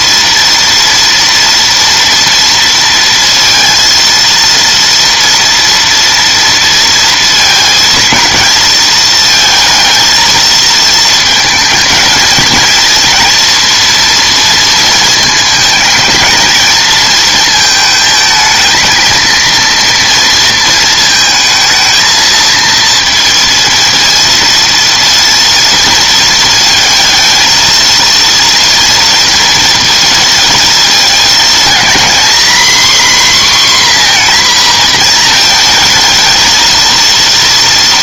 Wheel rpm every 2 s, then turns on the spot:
230, 230, 230, 230, 220, 220, 230, 230, 230, 220, 230, 230, 230, 220, 230, 230, 250, 240, 230.
none